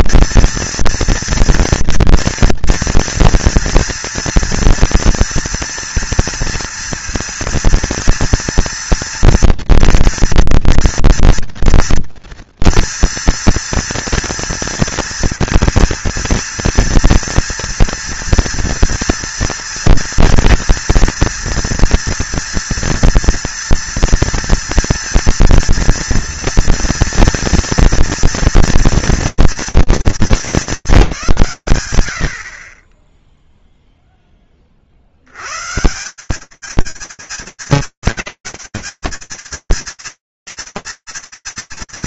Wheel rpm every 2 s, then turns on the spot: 230, 230, 230, 230, 230, 230, 230, 230, 230, 230, 230, 230, 230, 230, 230, 210, 50, 40, 200, 230, 180.
none